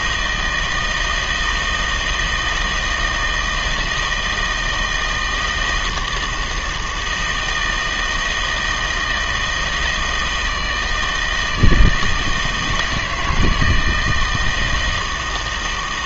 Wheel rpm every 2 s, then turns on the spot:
160, 160, 160, 160, 160, 160, 160, 160.
none